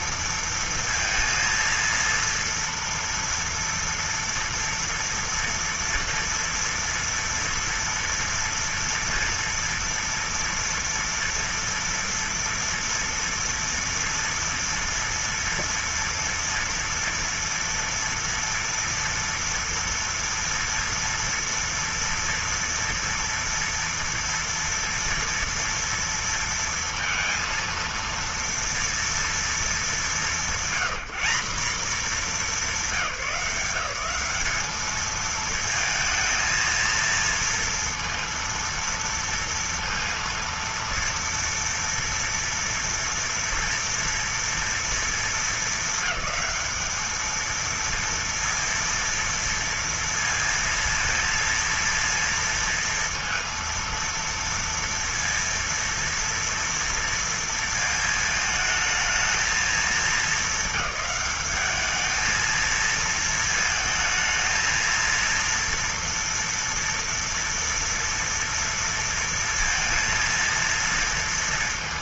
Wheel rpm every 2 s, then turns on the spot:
230, 230, 230, 230, 230, 230, 230, 230, 230, 230, 230, 230, 230, 230, 230, 210, 200, 200, 230, 230, 230, 230, 230, 220, 230, 230, 230, 230, 230, 220, 210, 220, 220, 230, 230, 230.
none